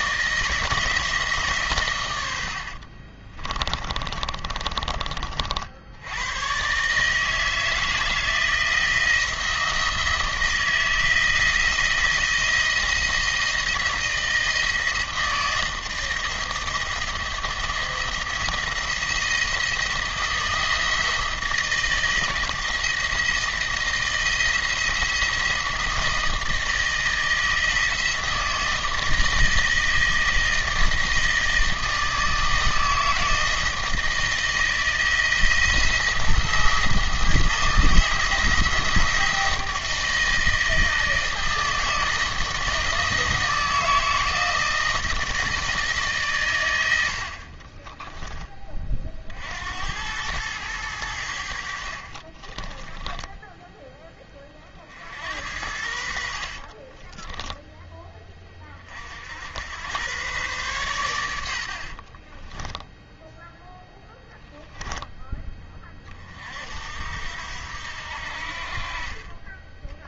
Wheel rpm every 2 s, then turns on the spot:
160, 60, 30, 130, 160, 170, 160, 160, 170, 170, 160, 160, 170, 160, 160, 160, 160, 160, 170, 170, 160, 160, 160, 110, 30, 100, 20, 40, 40, 30, 120, 10, 10, 60, 40.
2-6 52-54 56-58 62-64